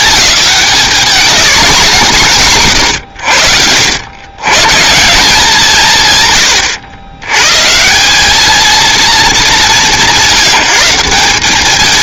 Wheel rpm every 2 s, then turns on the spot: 210, 140, 140, 100, 220, 160.
2-4